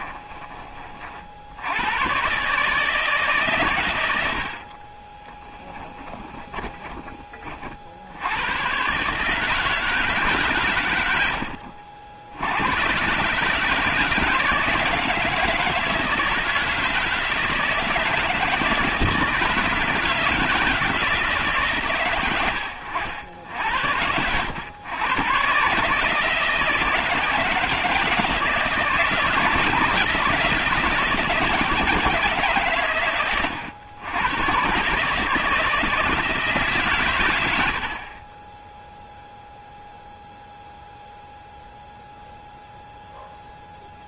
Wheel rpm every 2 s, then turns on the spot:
20, 140, 70, 20, 100, 130, 80, 160, 160, 160, 160, 100, 90, 160, 160, 160, 140, 120, 160, 20, 0, 0.
6-8